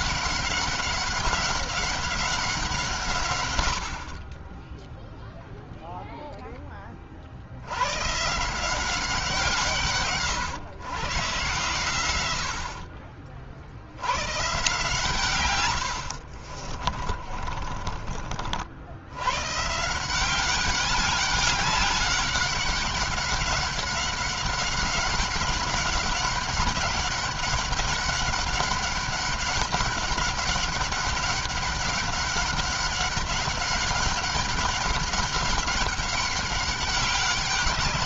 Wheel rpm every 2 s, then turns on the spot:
200, 180, 10, 20, 180, 120, 60, 140, 30, 70, 200, 190, 190, 190, 200, 200, 200, 200, 200.
16-18